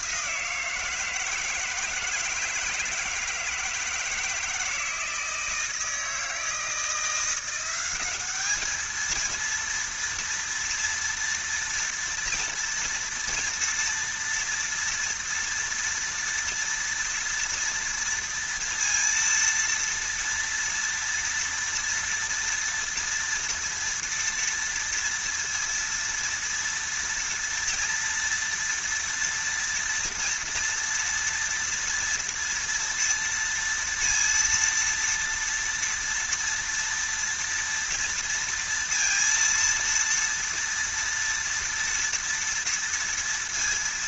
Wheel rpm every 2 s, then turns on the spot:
170, 160, 160, 170, 220, 240, 230, 230, 230, 230, 230, 230, 230, 230, 230, 230, 230, 230, 230, 230, 230, 230.
none